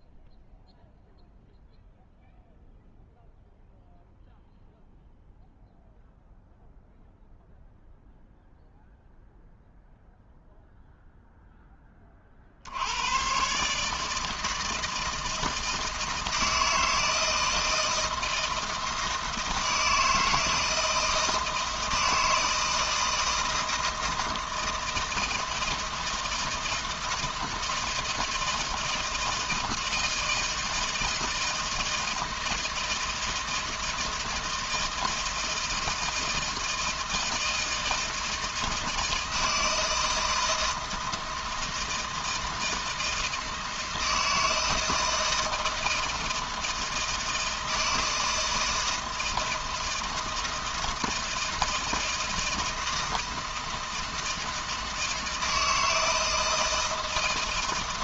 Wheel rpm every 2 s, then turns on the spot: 0, 0, 0, 0, 0, 0, 80, 160, 160, 160, 160, 160, 160, 170, 160, 160, 160, 160, 160, 160, 160, 160, 160, 160, 160, 160, 160, 160, 160.
none